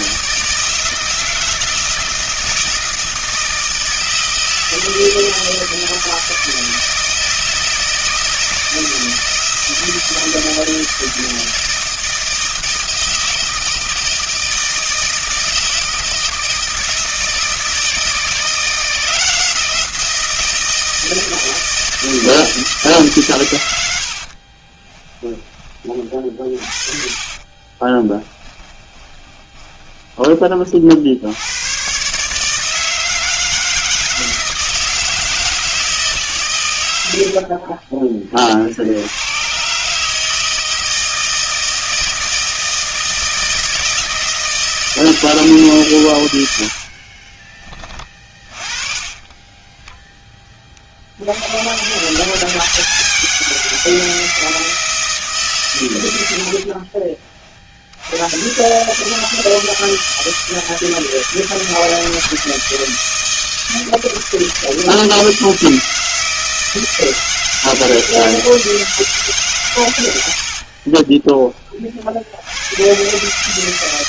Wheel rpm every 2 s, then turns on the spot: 160, 160, 160, 160, 160, 160, 160, 160, 160, 170, 170, 160, 50, 30, 20, 30, 150, 160, 130, 40, 160, 160, 160, 90, 30, 20, 170, 160, 80, 110, 160, 160, 160, 160, 160, 70, 80.
24-26 28-30 46-50 70-72